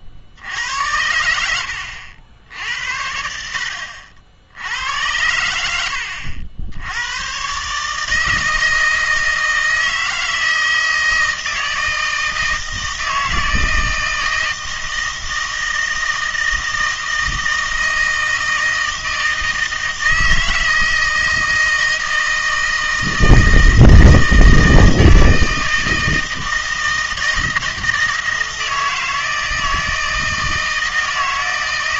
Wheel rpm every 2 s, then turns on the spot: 80, 80, 80, 90, 160, 160, 160, 160, 160, 160, 160, 160, 160, 160, 160, 160.
0-2